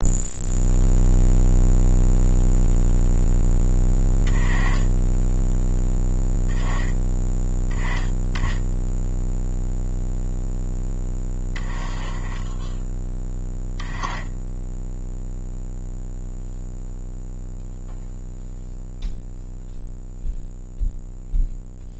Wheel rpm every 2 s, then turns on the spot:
0, 0, 20, 10, 10, 10, 10, 0, 0, 0, 0.
none